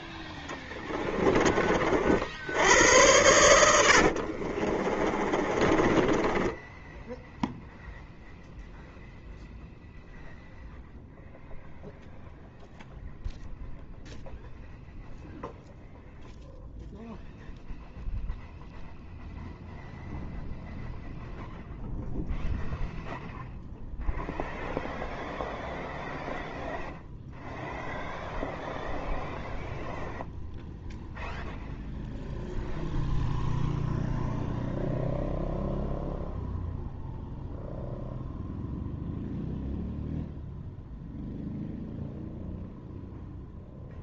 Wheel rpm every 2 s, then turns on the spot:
10, 90, 40, 10, 0, 0, 0, 0, 0, 0, 0, 0, 0, 0, 0, 0, 0, 0, 0, 0, 0, 0.
0-2 4-8